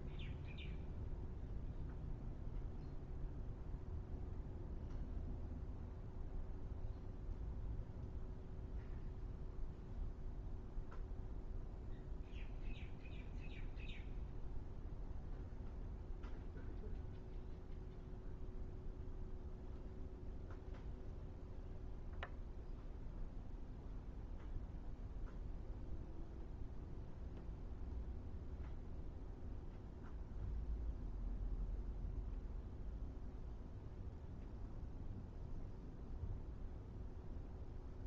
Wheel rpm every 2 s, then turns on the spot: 0, 0, 0, 0, 0, 0, 0, 0, 0, 0, 0, 0, 0, 0, 0, 0, 0, 0, 0.
none